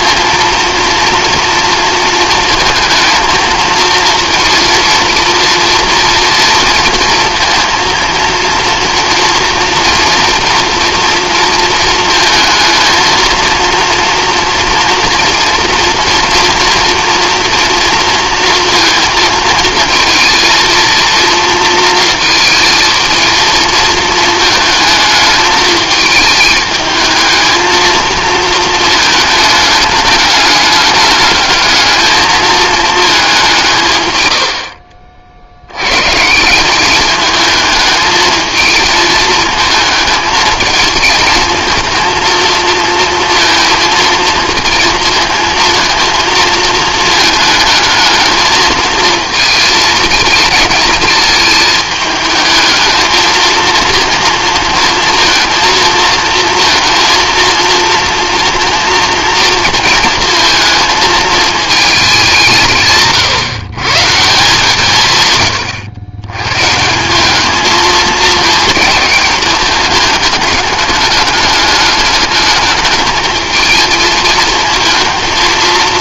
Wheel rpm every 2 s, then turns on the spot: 230, 220, 230, 230, 230, 230, 230, 230, 230, 220, 230, 220, 220, 220, 210, 210, 190, 50, 220, 220, 220, 230, 230, 220, 220, 220, 230, 230, 230, 230, 220, 130, 120, 200, 210, 210, 210, 220.
none